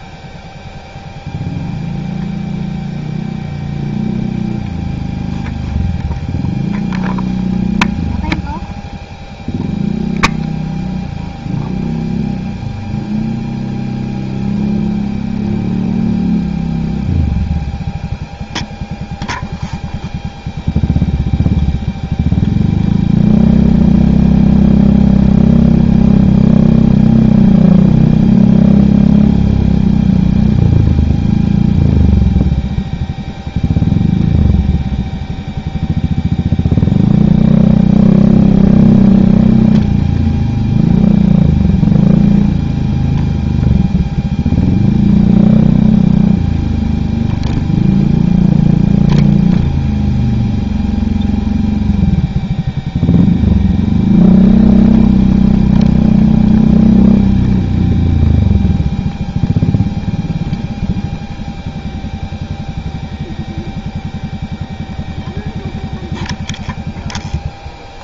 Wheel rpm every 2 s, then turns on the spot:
0, 0, 0, 0, 0, 0, 0, 0, 0, 0, 0, 0, 0, 0, 0, 0, 0, 0, 0, 0, 0, 0, 0, 0, 0, 0, 0, 0, 0, 0, 0, 0, 0, 0.
none